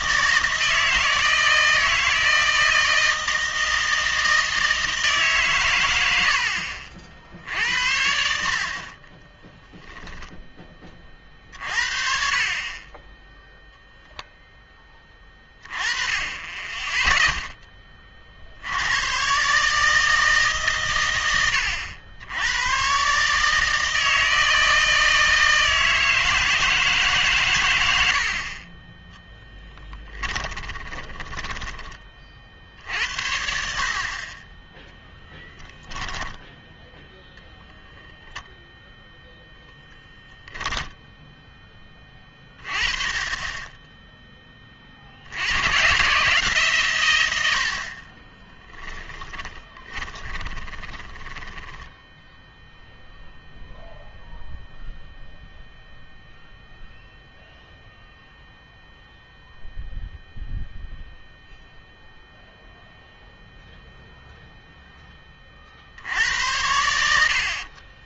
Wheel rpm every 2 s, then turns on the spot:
160, 160, 160, 70, 60, 10, 30, 10, 10, 70, 140, 100, 160, 160, 30, 20, 60, 10, 0, 0, 0, 20, 20, 140, 10, 10, 0, 0, 0, 0, 0, 0, 0, 80.
30-32 48-52